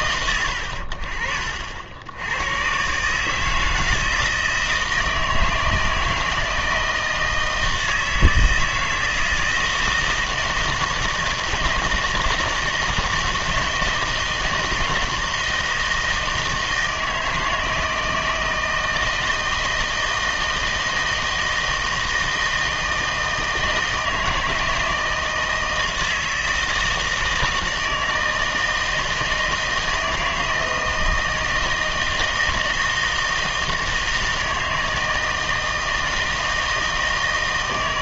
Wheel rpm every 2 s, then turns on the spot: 70, 120, 160, 160, 160, 160, 160, 160, 160, 160, 160, 160, 160, 160, 160, 170, 160, 160, 160.
none